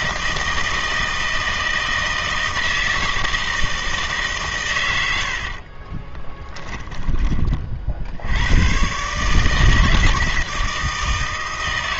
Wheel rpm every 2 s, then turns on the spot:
160, 160, 130, 20, 100, 160.
6-8